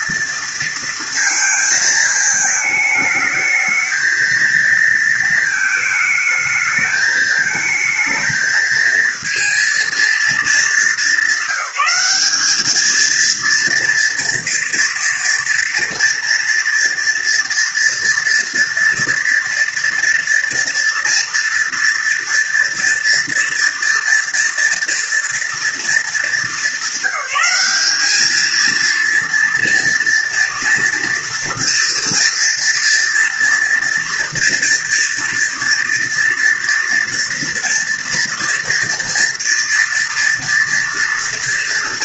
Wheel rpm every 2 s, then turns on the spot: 230, 220, 230, 220, 220, 220, 210, 240, 230, 240, 230, 240, 240, 210, 220, 230, 230, 230, 230, 230, 230.
none